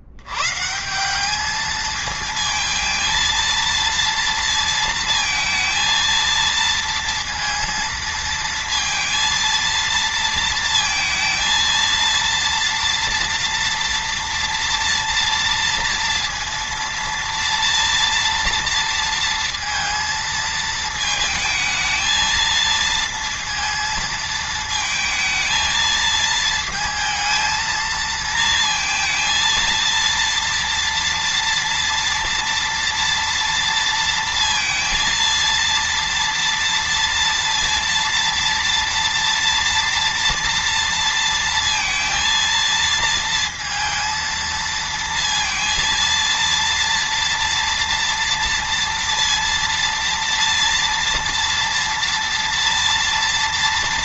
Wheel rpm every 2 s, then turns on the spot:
170, 220, 230, 230, 230, 230, 230, 230, 230, 230, 220, 230, 220, 220, 230, 230, 230, 230, 230, 230, 230, 230, 230, 230, 230, 230, 230.
none